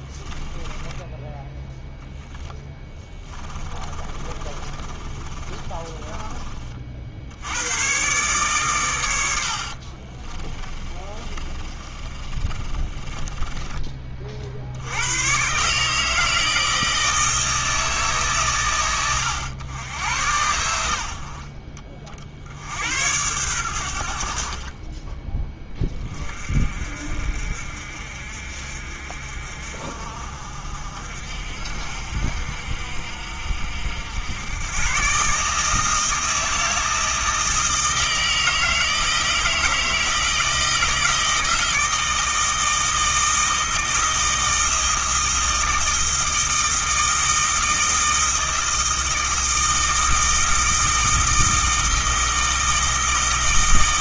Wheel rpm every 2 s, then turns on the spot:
10, 20, 30, 40, 110, 30, 30, 80, 160, 110, 70, 90, 30, 50, 50, 60, 60, 120, 160, 160, 160, 160, 160, 160, 160, 160, 160.
0-6 10-14